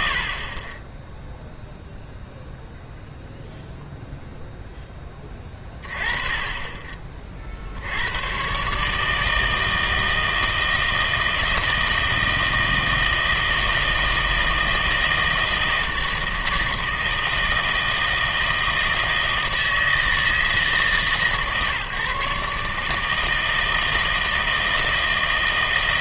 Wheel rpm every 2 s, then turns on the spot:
20, 0, 10, 20, 140, 160, 160, 160, 160, 160, 150, 150, 160.
none